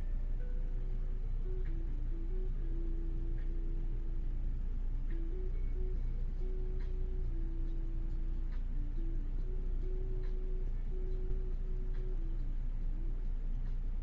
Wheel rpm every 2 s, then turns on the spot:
0, 0, 0, 0, 0, 0, 0.
none